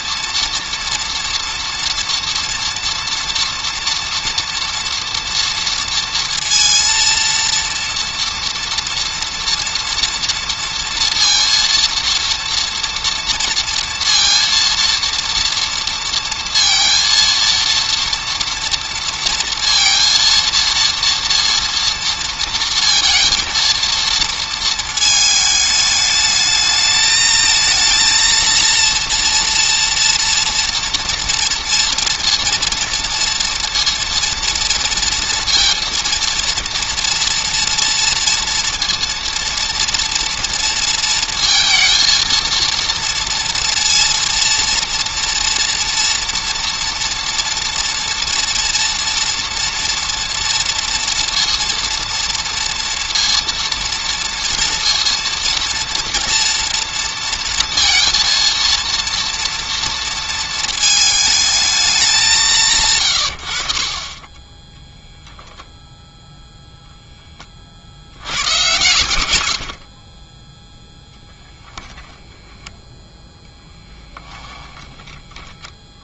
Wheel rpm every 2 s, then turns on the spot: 230, 240, 240, 230, 230, 230, 230, 230, 230, 230, 230, 230, 230, 210, 230, 230, 230, 230, 230, 230, 230, 230, 230, 230, 230, 230, 230, 230, 230, 230, 230, 160, 10, 0, 110, 10, 10, 10.
74-76